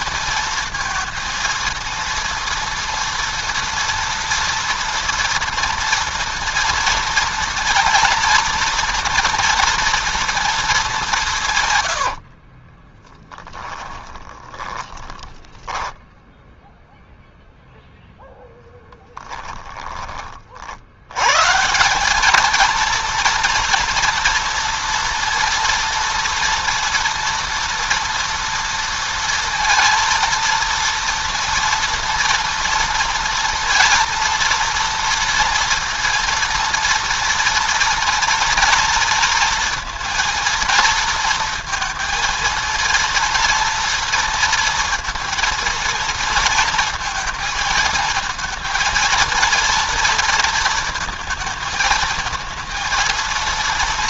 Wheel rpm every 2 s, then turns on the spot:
230, 230, 230, 230, 230, 200, 30, 20, 0, 10, 80, 230, 230, 230, 230, 230, 230, 230, 230, 230, 230, 230, 230, 230, 220, 230, 220.
12-16